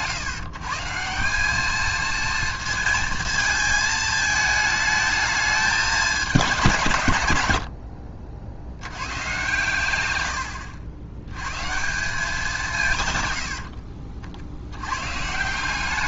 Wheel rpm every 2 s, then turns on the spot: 140, 230, 220, 180, 80, 70, 140, 80.
none